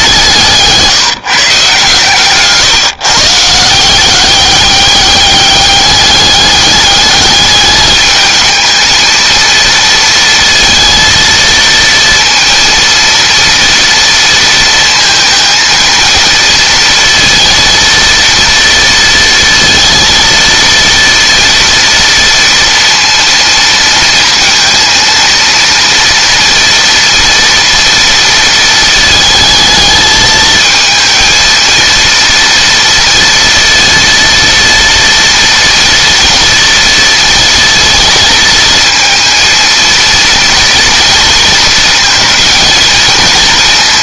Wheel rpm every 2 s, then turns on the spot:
150, 140, 200, 210, 220, 230, 230, 230, 230, 230, 230, 230, 230, 230, 220, 220, 230, 230, 230, 230, 230, 220.
none